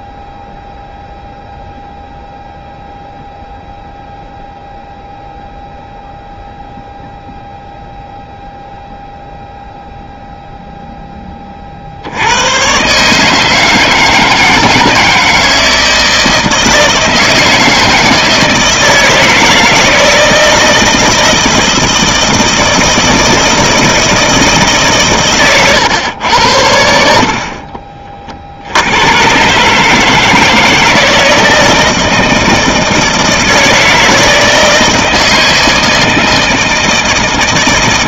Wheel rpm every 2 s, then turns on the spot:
0, 0, 0, 0, 0, 0, 120, 160, 160, 160, 160, 160, 150, 80, 60, 160, 160, 160, 160.
none